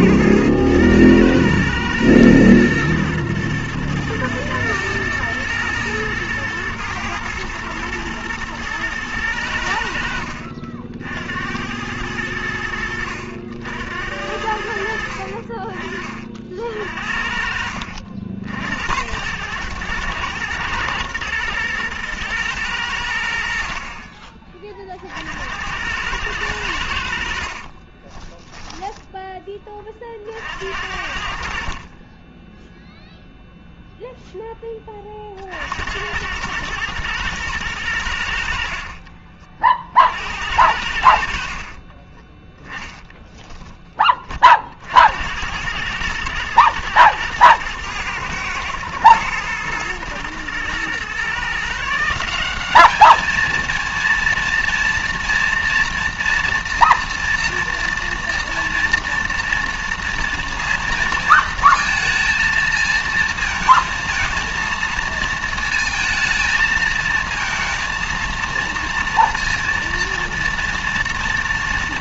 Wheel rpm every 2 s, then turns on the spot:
110, 110, 110, 110, 110, 60, 80, 70, 50, 70, 110, 110, 30, 100, 20, 60, 10, 10, 100, 60, 70, 10, 40, 110, 120, 120, 190, 230, 230, 230, 230, 220, 220, 220, 230, 230.
28-30